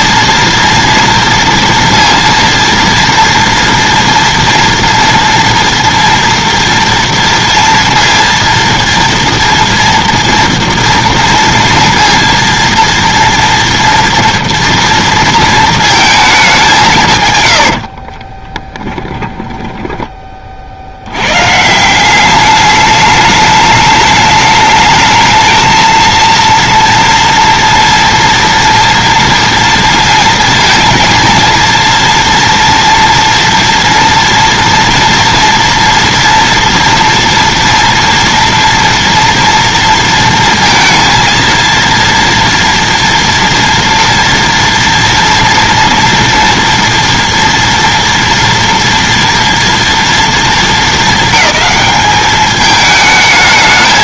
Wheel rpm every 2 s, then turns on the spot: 230, 230, 230, 230, 230, 230, 230, 230, 200, 20, 40, 200, 210, 230, 240, 230, 230, 230, 230, 230, 230, 230, 230, 230, 230, 210, 210.
18-20